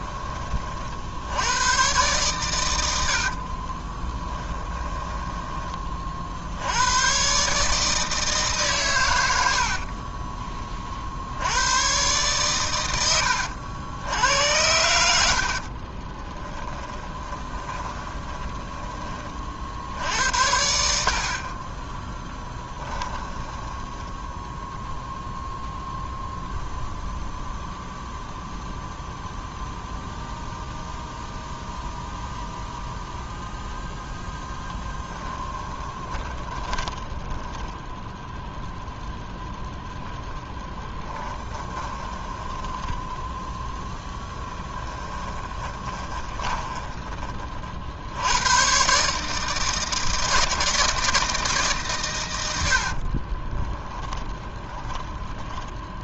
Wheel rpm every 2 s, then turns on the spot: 50, 90, 10, 80, 130, 40, 100, 70, 10, 20, 80, 20, 0, 0, 0, 0, 0, 10, 20, 0, 10, 10, 20, 20, 130, 160, 80, 10.
4-6 16-18 22-24 34-38 40-48 52-56